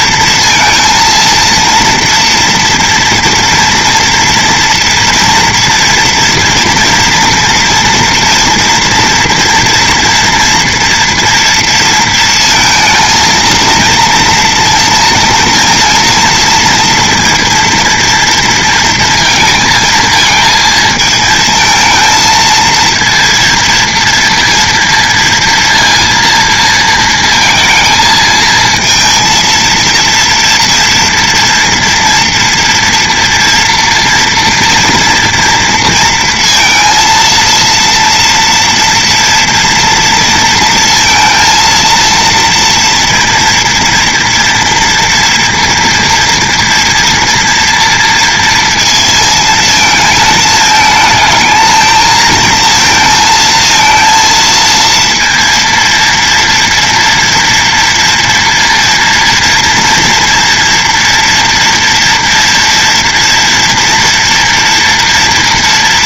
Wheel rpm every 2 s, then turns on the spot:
230, 230, 230, 230, 230, 230, 230, 230, 230, 230, 220, 230, 230, 230, 230, 240, 230, 230, 230, 230, 230, 230, 230, 240, 230, 220, 230, 230, 230, 230, 230, 230, 230.
none